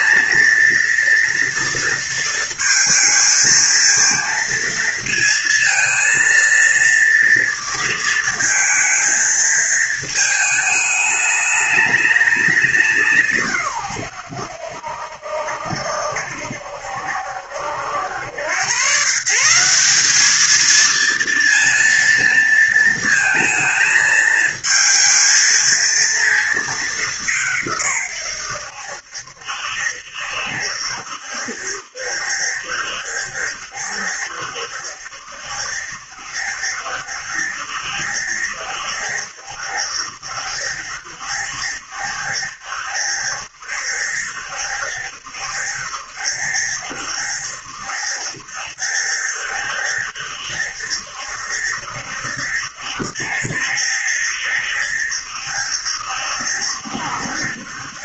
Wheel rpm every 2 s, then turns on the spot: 230, 230, 230, 230, 220, 210, 200, 90, 70, 120, 220, 230, 220, 220, 100, 70, 70, 70, 70, 70, 70, 70, 70, 70, 70, 70, 70, 70, 70.
none